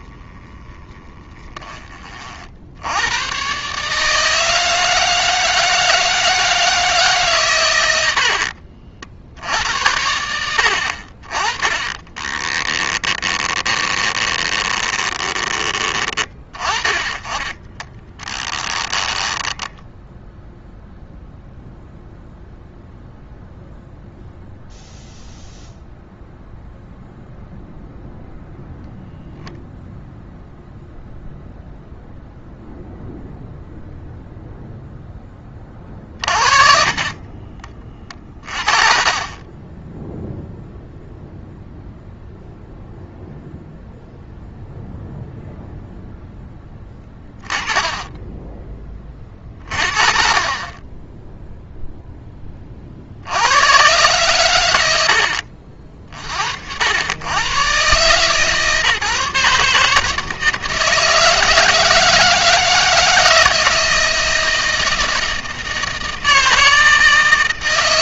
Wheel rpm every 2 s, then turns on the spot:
10, 90, 160, 160, 60, 60, 10, 20, 20, 10, 0, 0, 0, 0, 0, 0, 0, 0, 40, 30, 0, 0, 0, 10, 20, 20, 50, 80, 80, 140, 160, 170, 170, 160.
0-2 12-16 18-20